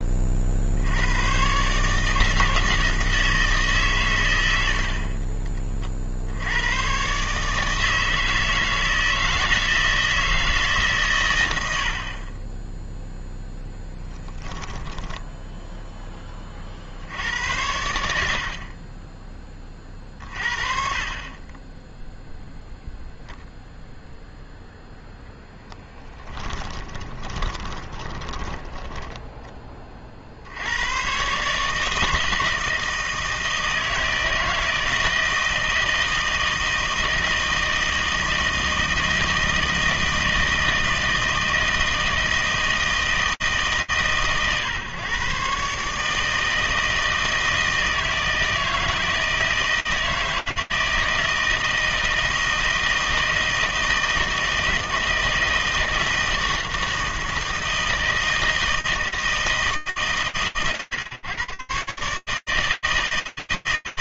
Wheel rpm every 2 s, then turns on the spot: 70, 160, 70, 100, 160, 150, 20, 10, 40, 40, 40, 0, 10, 20, 10, 90, 160, 160, 160, 160, 160, 160, 130, 160, 160, 160, 160, 160, 160, 160, 120, 160.
14-16 26-30